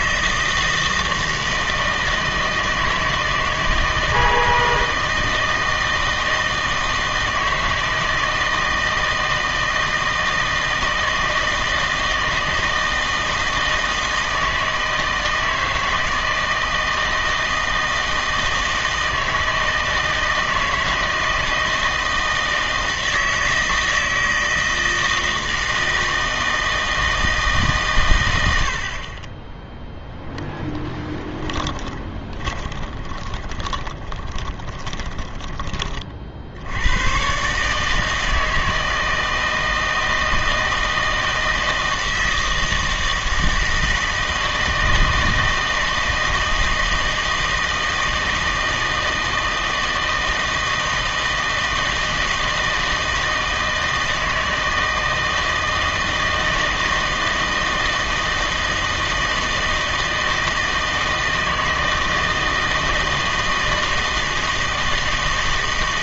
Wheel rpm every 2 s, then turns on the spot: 160, 160, 160, 160, 160, 160, 160, 160, 160, 160, 160, 160, 160, 160, 70, 0, 20, 20, 70, 160, 160, 160, 160, 160, 160, 160, 160, 160, 160, 160, 160, 160, 160.
32-36